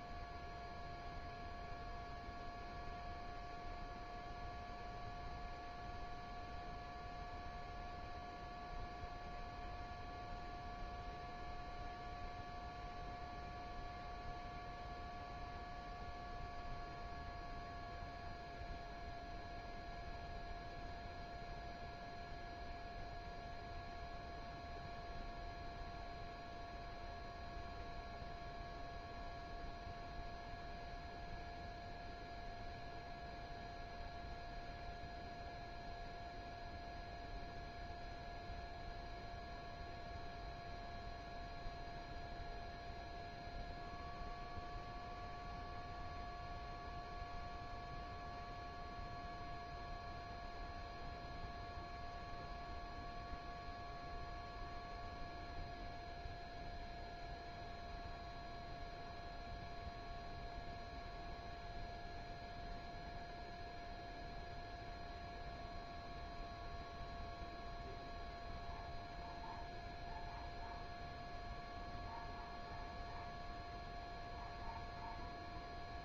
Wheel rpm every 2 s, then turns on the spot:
0, 0, 0, 0, 0, 0, 0, 0, 0, 0, 0, 0, 0, 0, 0, 0, 0, 0, 0, 0, 0, 0, 0, 0, 0, 0, 0, 0, 0, 0, 0, 0, 0, 0, 0, 0, 0, 0.
none